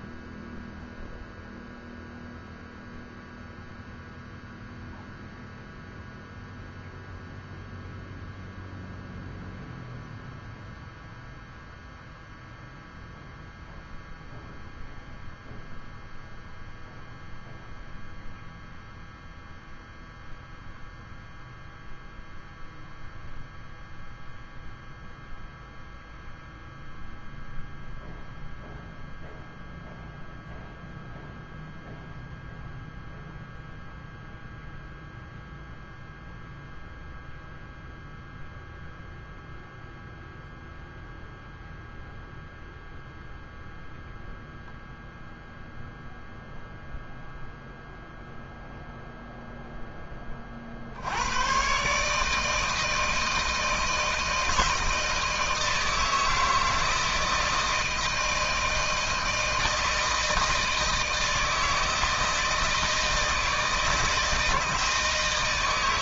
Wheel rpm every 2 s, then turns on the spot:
0, 0, 0, 0, 0, 0, 0, 0, 0, 0, 0, 0, 0, 0, 0, 0, 0, 0, 0, 0, 0, 0, 0, 0, 0, 70, 160, 160, 160, 160, 160, 160, 160.
none